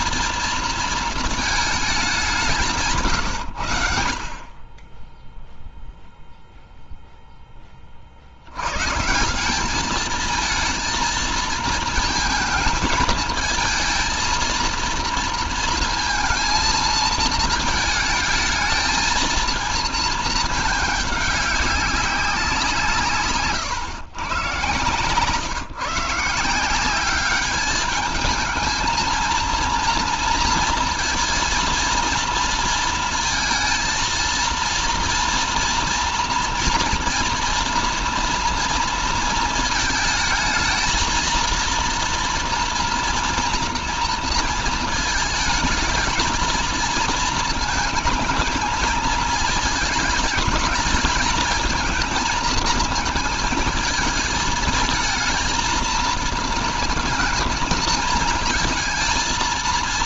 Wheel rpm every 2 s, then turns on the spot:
230, 170, 20, 0, 110, 220, 220, 230, 230, 220, 210, 180, 130, 180, 220, 230, 230, 230, 240, 230, 220, 230, 230, 230, 220, 220, 230, 220, 230, 220.
24-26